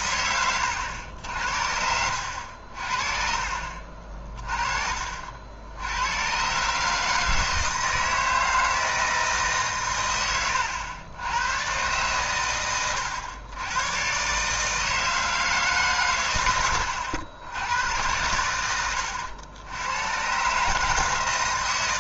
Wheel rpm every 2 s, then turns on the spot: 100, 60, 40, 140, 160, 100, 100, 150, 100, 100, 150.
16-18